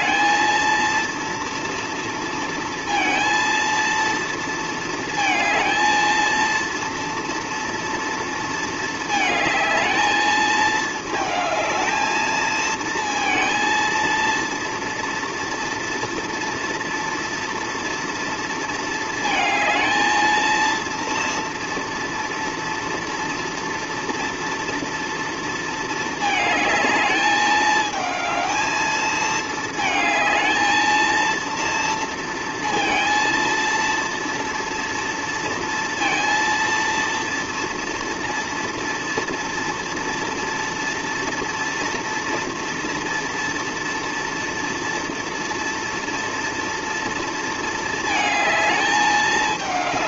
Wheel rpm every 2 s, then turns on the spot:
230, 230, 230, 230, 230, 220, 220, 230, 230, 230, 230, 230, 230, 220, 220, 220, 230, 230, 230, 230, 230, 230, 230, 230, 220.
none